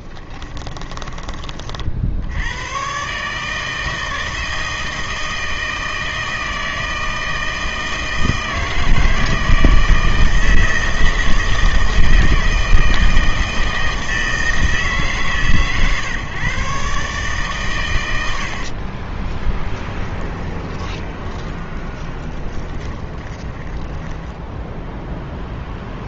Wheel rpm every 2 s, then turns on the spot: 20, 100, 160, 160, 160, 160, 160, 160, 140, 50, 20, 20, 10.
0-2 18-26